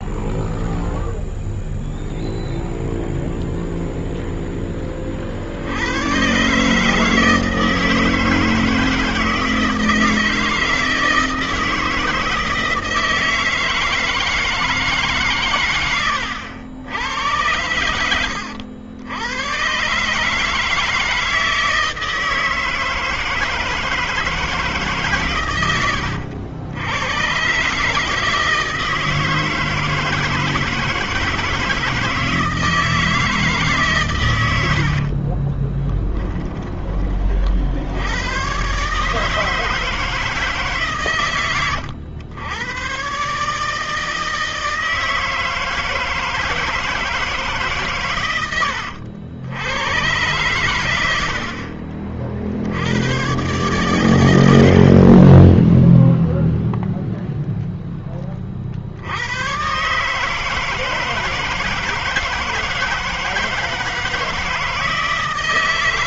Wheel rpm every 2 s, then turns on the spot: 0, 0, 0, 130, 160, 160, 160, 160, 100, 90, 150, 160, 160, 90, 160, 160, 160, 110, 20, 100, 160, 90, 160, 160, 110, 110, 60, 90, 0, 20, 150, 160, 160.
34-38